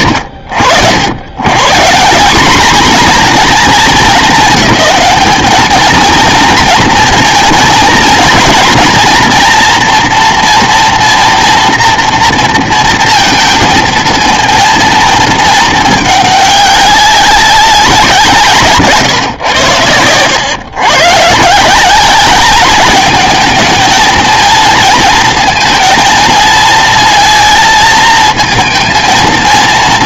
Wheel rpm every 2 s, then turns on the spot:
70, 220, 200, 230, 230, 240, 230, 230, 200, 150, 120, 210, 230, 220, 220.
none